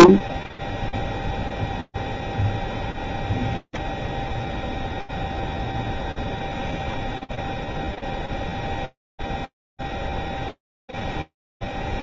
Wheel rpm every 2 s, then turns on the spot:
0, 0, 0, 0, 0, 0.
none